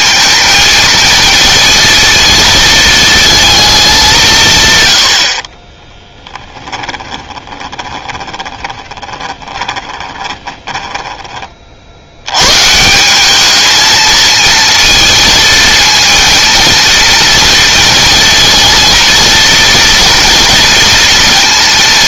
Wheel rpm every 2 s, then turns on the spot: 230, 220, 100, 10, 20, 20, 160, 230, 230, 230, 230.
6-12